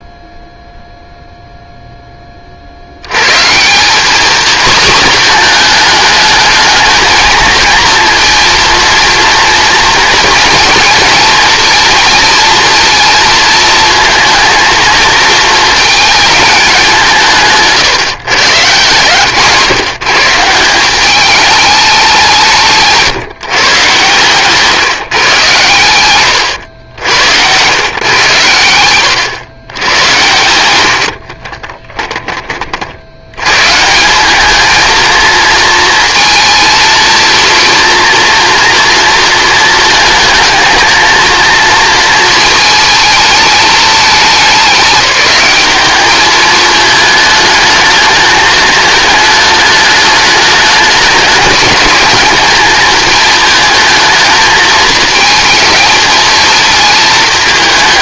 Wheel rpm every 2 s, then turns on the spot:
0, 60, 240, 220, 230, 220, 230, 230, 200, 130, 180, 170, 140, 100, 100, 90, 50, 220, 230, 230, 230, 220, 180, 210, 210, 210, 210, 220, 220.
28-32